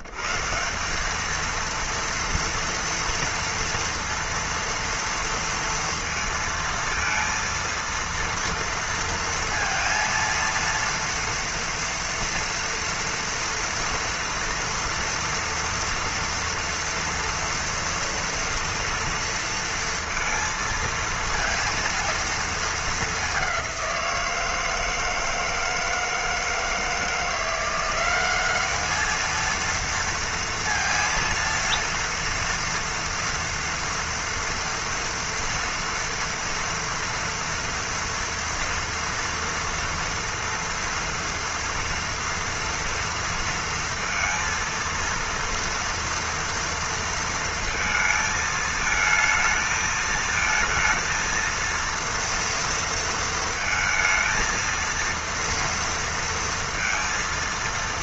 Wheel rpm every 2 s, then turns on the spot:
140, 230, 230, 230, 230, 230, 230, 230, 230, 230, 230, 230, 170, 160, 190, 230, 230, 230, 230, 230, 230, 230, 230, 230, 220, 220, 230, 230, 230.
none